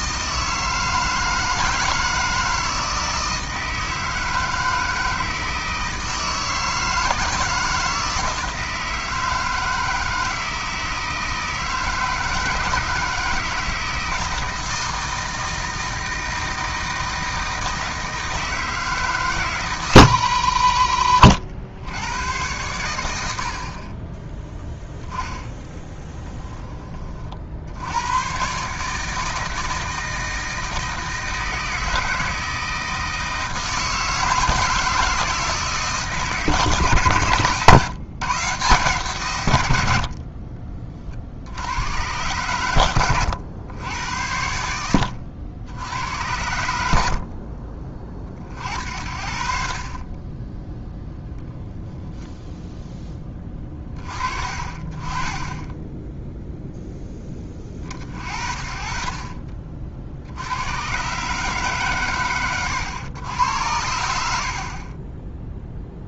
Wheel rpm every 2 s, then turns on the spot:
160, 160, 160, 160, 160, 160, 160, 160, 160, 160, 60, 100, 10, 30, 150, 160, 160, 160, 130, 130, 40, 100, 80, 80, 60, 10, 10, 30, 10, 40, 110, 100, 30.
none